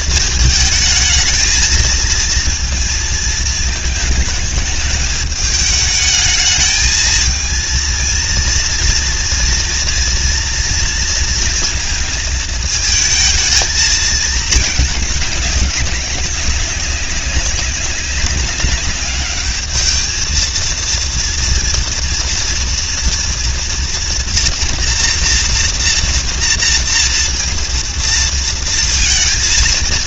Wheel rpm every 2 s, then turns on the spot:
220, 230, 220, 220, 230, 230, 220, 210, 190, 200, 230, 230, 230, 230, 230.
none